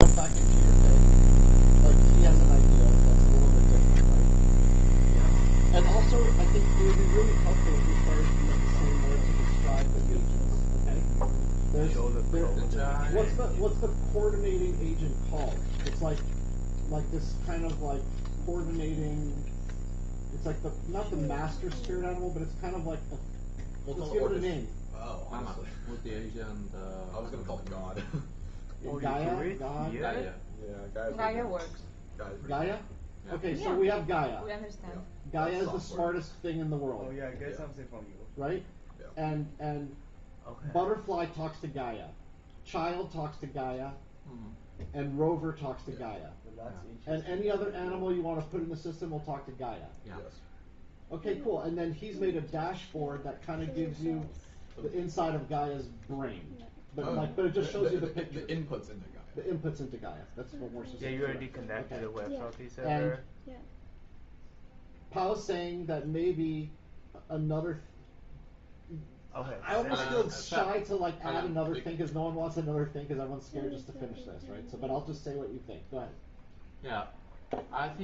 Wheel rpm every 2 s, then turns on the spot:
0, 0, 10, 20, 10, 0, 0, 0, 0, 0, 0, 0, 0, 0, 0, 0, 0, 0, 0, 0, 0, 0, 0, 0, 0, 0, 0, 0, 0, 0, 0, 0, 0, 0, 0, 0, 0, 0, 0.
4-10